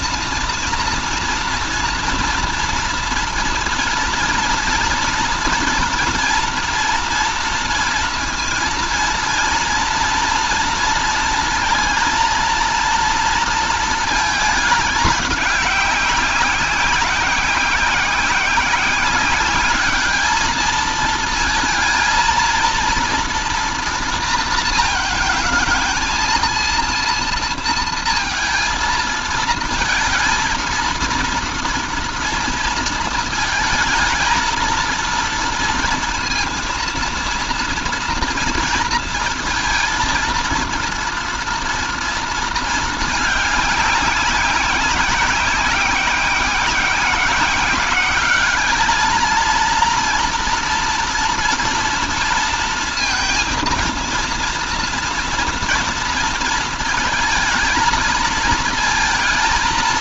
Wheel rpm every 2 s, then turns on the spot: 230, 230, 230, 230, 230, 230, 230, 210, 190, 190, 220, 240, 230, 230, 230, 230, 230, 230, 230, 230, 230, 220, 190, 180, 210, 230, 230, 230, 230, 230.
none